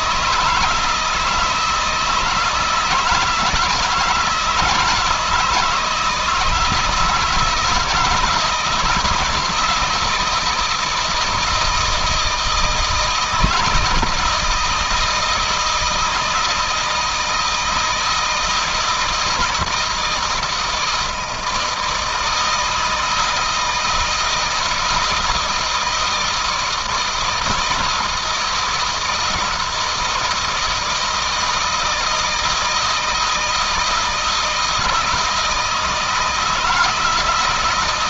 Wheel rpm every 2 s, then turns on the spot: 160, 160, 160, 160, 170, 160, 160, 160, 160, 160, 160, 160, 160, 160, 160, 160, 160, 160, 160.
none